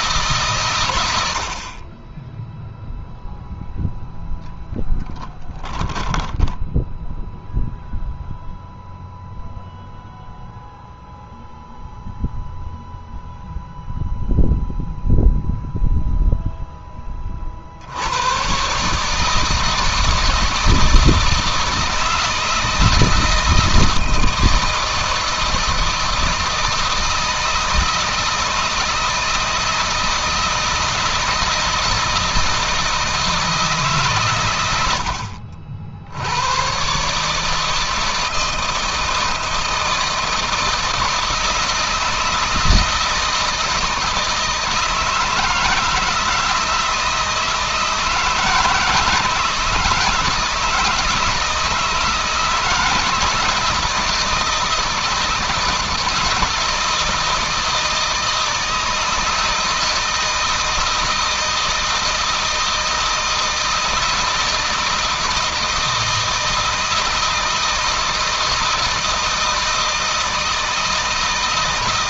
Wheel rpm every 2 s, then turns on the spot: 120, 0, 0, 10, 0, 0, 0, 0, 0, 130, 160, 160, 160, 160, 160, 160, 160, 100, 110, 160, 160, 160, 160, 160, 160, 160, 160, 160, 160, 160, 160, 160, 160, 160, 160, 160.
none